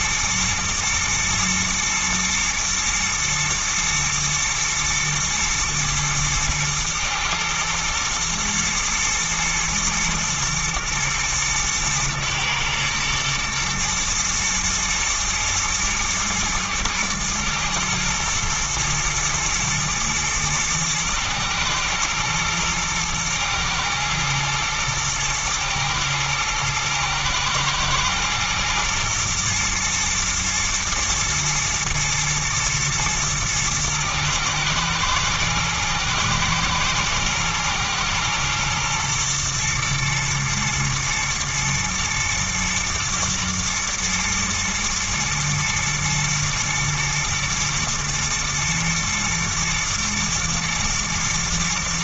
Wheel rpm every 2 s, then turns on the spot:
110, 110, 110, 110, 110, 110, 110, 120, 110, 120, 110, 110, 110, 110, 120, 120, 110, 110, 110, 120, 120, 110, 110, 110, 120, 110.
none